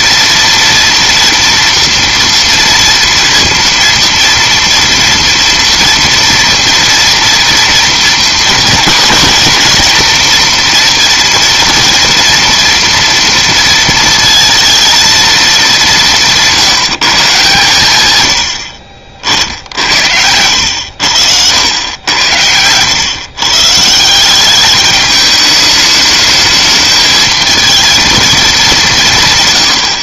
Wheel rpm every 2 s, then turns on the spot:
230, 230, 230, 230, 230, 230, 230, 230, 170, 70, 90, 100, 200, 220, 200.
none